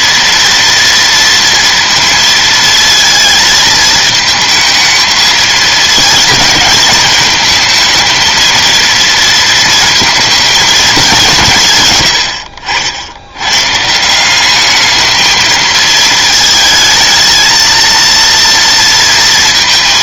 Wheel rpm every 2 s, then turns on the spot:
230, 230, 220, 220, 230, 220, 80, 210, 220, 230.
none